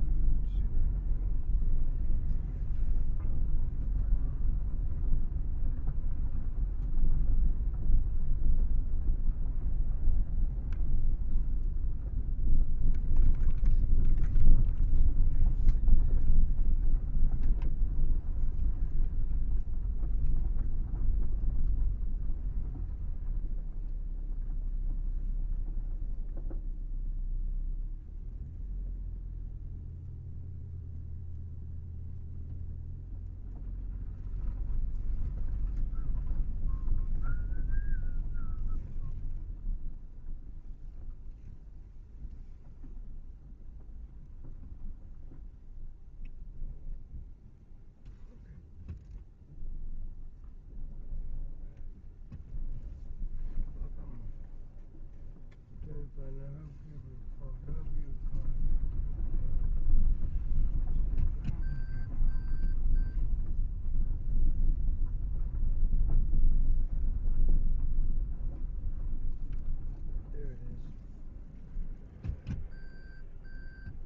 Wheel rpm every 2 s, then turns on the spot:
0, 0, 0, 0, 0, 0, 0, 0, 0, 0, 0, 0, 0, 0, 0, 0, 0, 0, 0, 0, 0, 0, 0, 0, 0, 0, 0, 0, 0, 0, 0, 0, 0, 0, 0, 0, 0.
none